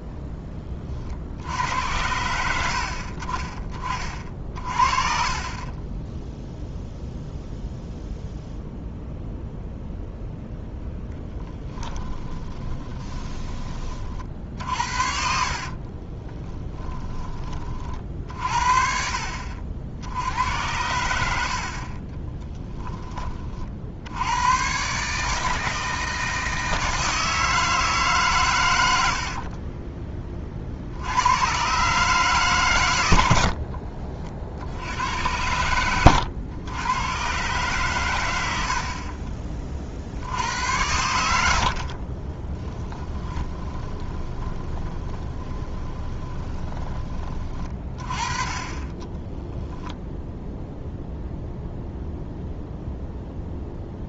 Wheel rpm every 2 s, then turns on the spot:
20, 80, 30, 0, 0, 0, 20, 60, 20, 50, 80, 10, 120, 160, 100, 50, 130, 70, 100, 70, 90, 20, 20, 20, 30, 0, 0.
12-14 16-18 42-48